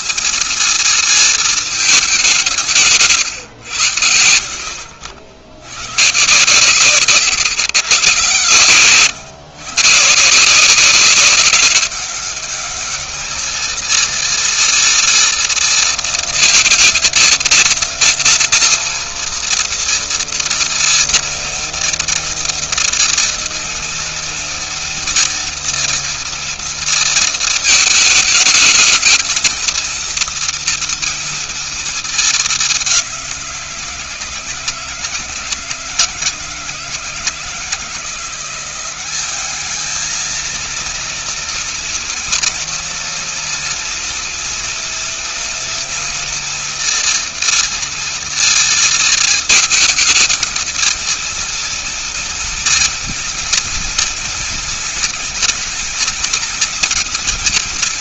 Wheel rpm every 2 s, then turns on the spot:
230, 140, 70, 140, 130, 190, 210, 230, 230, 230, 230, 230, 230, 230, 220, 230, 190, 160, 160, 190, 230, 230, 240, 230, 230, 230, 230, 230, 230.
2-4 6-8